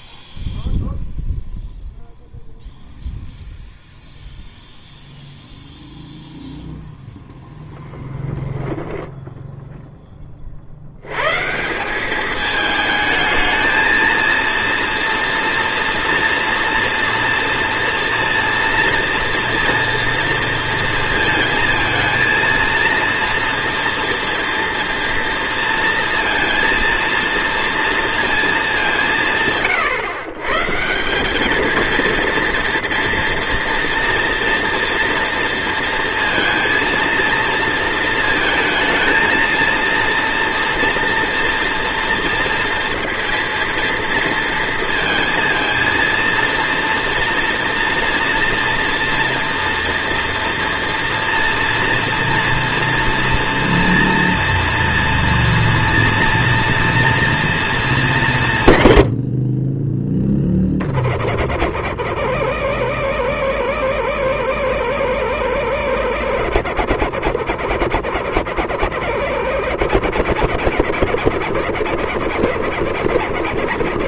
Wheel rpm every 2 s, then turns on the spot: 0, 0, 0, 0, 0, 50, 210, 230, 230, 230, 230, 230, 230, 230, 210, 140, 230, 230, 230, 220, 230, 230, 230, 230, 230, 230, 230, 230, 230, 150, 20, 60, 70, 70, 60, 60, 70.
none